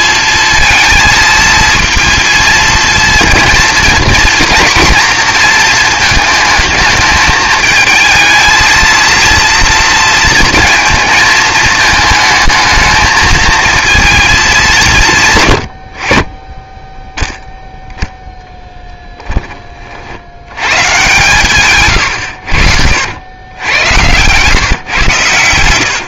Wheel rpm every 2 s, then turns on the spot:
230, 230, 230, 220, 220, 230, 220, 190, 20, 10, 110, 90, 130.
18-20 22-24